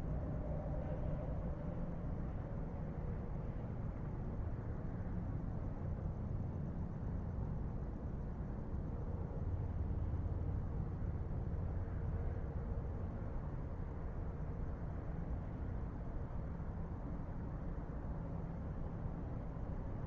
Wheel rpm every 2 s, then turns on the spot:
0, 0, 0, 0, 0, 0, 0, 0, 0, 0.
none